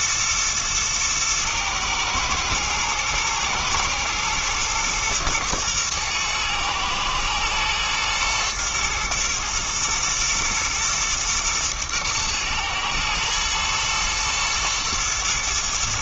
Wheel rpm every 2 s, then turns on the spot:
110, 110, 110, 120, 120, 110, 110, 110.
none